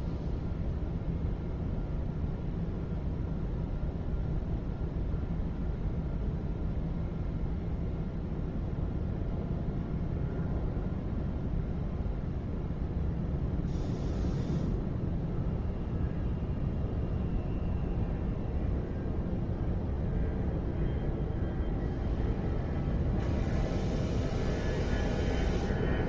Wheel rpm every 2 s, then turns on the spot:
0, 0, 0, 0, 0, 0, 0, 0, 0, 0, 0, 0, 0.
none